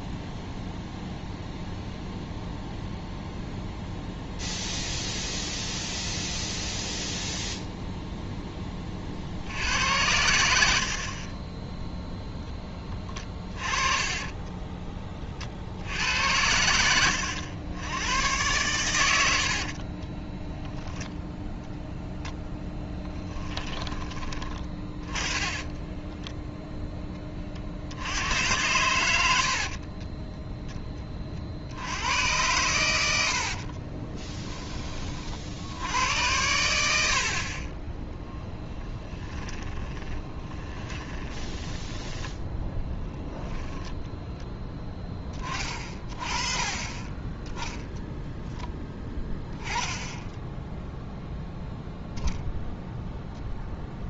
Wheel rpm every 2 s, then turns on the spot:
0, 0, 0, 0, 20, 70, 10, 20, 90, 100, 0, 10, 20, 10, 90, 10, 100, 20, 90, 10, 20, 10, 10, 30, 10, 0, 0.
14-16 22-24 38-42